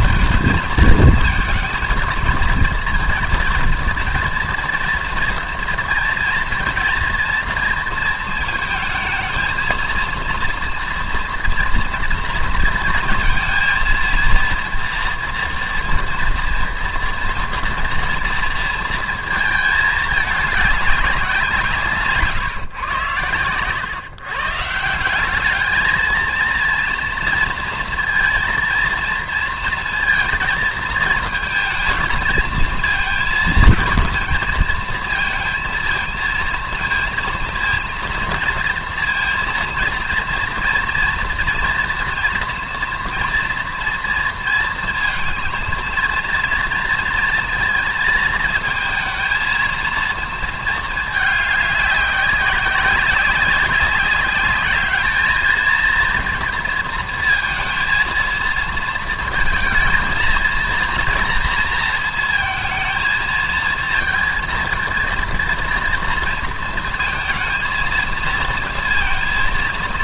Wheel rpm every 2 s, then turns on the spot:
220, 230, 240, 230, 220, 230, 230, 230, 240, 230, 200, 120, 170, 230, 230, 220, 220, 230, 230, 230, 230, 230, 220, 230, 220, 220, 200, 200, 230, 230, 230, 220, 230, 220, 230.
none